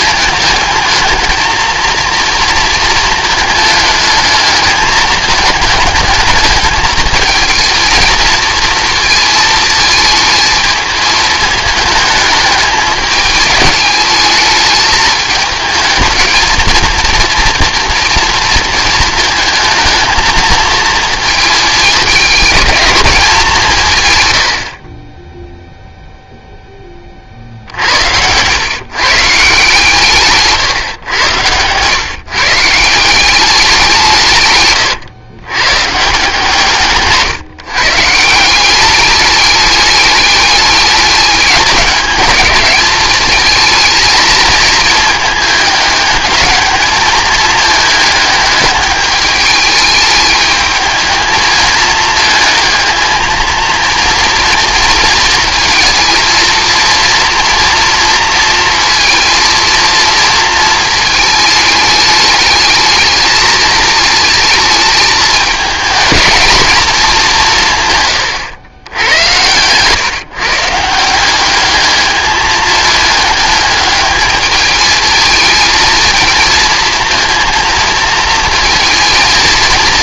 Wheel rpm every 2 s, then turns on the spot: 220, 230, 220, 220, 220, 220, 210, 220, 230, 230, 220, 220, 50, 20, 130, 130, 160, 120, 150, 190, 210, 210, 220, 220, 210, 220, 220, 230, 230, 230, 220, 210, 220, 220, 100, 160, 210, 220, 230, 230.
24-26